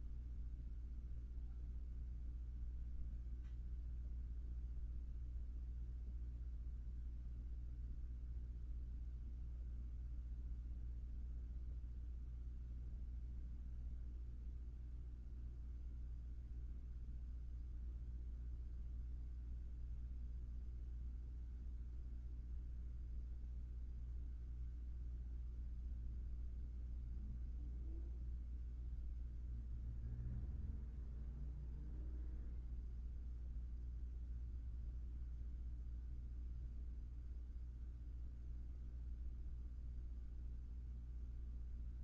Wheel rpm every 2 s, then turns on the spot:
0, 0, 0, 0, 0, 0, 0, 0, 0, 0, 0, 0, 0, 0, 0, 0, 0, 0, 0, 0, 0.
none